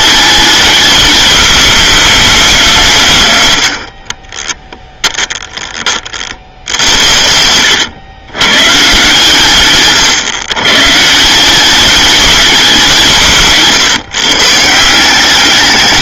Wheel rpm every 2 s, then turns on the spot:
210, 140, 10, 90, 140, 160, 170, 150.
4-8